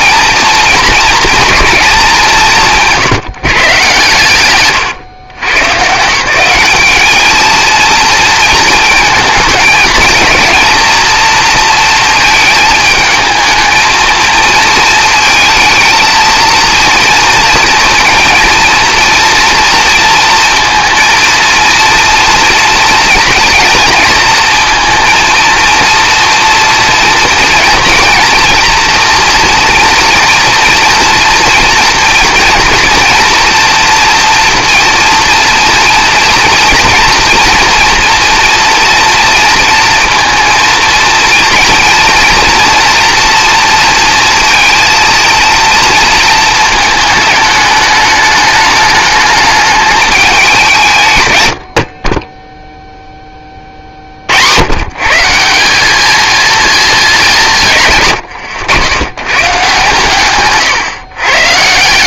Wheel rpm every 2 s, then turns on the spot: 220, 160, 150, 190, 230, 230, 220, 230, 230, 230, 230, 230, 230, 230, 230, 230, 240, 240, 240, 230, 230, 230, 230, 220, 210, 160, 0, 110, 220, 80, 130.
none